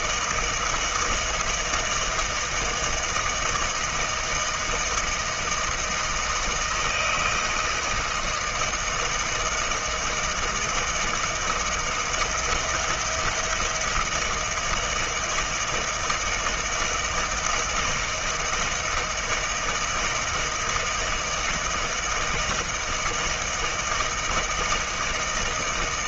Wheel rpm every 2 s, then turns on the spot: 160, 160, 160, 160, 160, 160, 170, 160, 160, 160, 160, 160, 160.
none